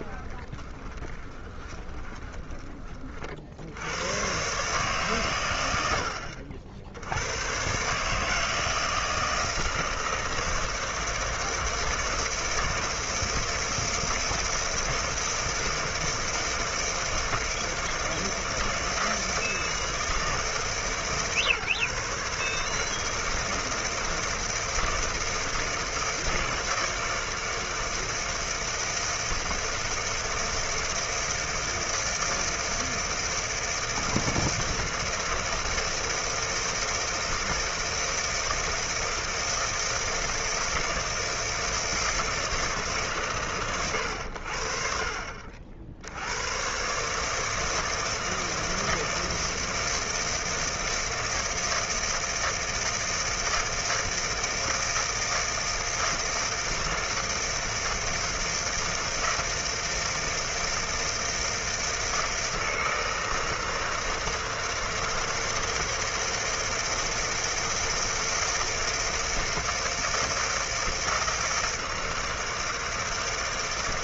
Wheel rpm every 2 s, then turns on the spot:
20, 30, 130, 70, 160, 160, 160, 160, 160, 160, 160, 150, 160, 160, 160, 160, 160, 160, 160, 160, 160, 160, 60, 110, 160, 160, 160, 160, 160, 160, 160, 160, 160, 160, 160, 160, 160.
0-2